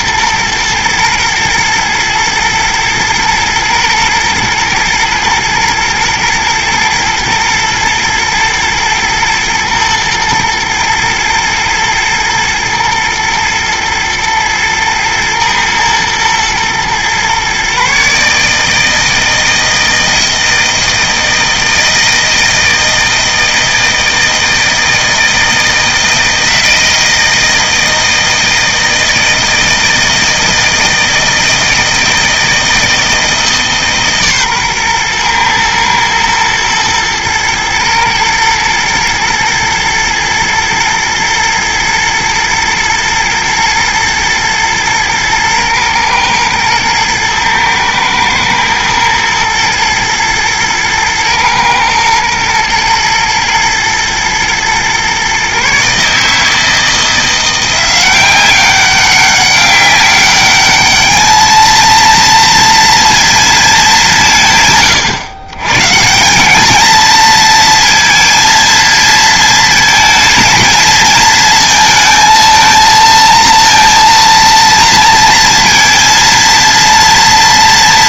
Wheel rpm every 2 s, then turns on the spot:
120, 110, 110, 120, 110, 110, 110, 120, 120, 160, 160, 160, 160, 160, 160, 160, 160, 130, 110, 110, 110, 120, 110, 110, 110, 110, 110, 120, 160, 190, 210, 230, 130, 220, 230, 220, 230, 230, 230.
none